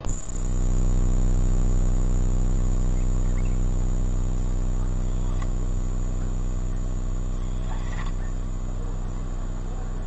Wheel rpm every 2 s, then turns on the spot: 0, 0, 0, 0, 0.
none